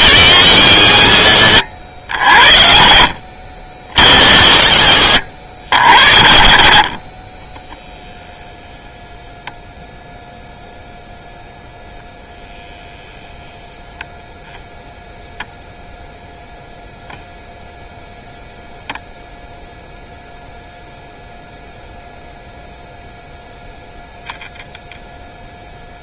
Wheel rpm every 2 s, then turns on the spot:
80, 40, 60, 30, 0, 0, 0, 0, 0, 0, 0, 0, 0.
none